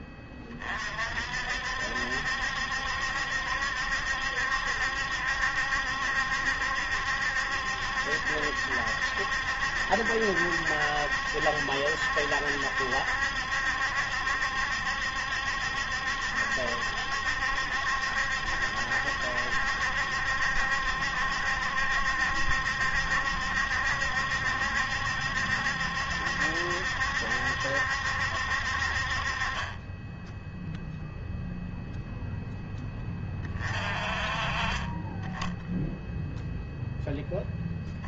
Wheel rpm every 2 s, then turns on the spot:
40, 70, 70, 70, 70, 70, 70, 70, 70, 70, 70, 70, 70, 70, 50, 0, 10, 30, 0.
none